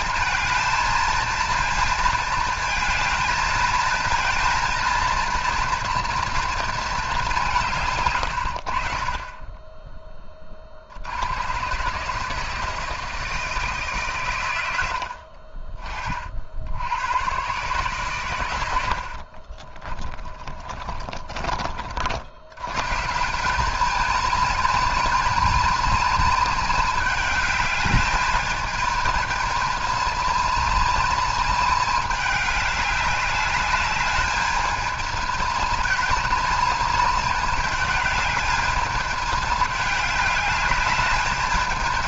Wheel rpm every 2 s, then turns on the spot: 230, 220, 230, 220, 50, 70, 150, 80, 80, 90, 30, 130, 220, 210, 220, 230, 200, 220, 220, 220, 220.
18-22